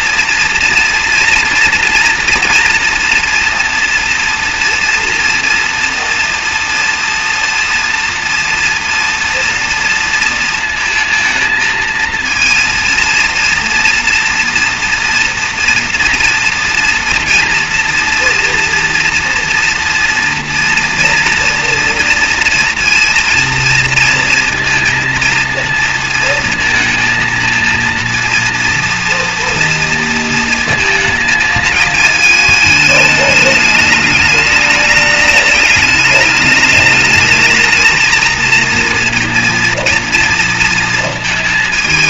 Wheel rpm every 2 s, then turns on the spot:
230, 230, 230, 230, 230, 220, 230, 240, 230, 230, 230, 230, 230, 230, 230, 220, 220, 210, 210, 230, 230.
none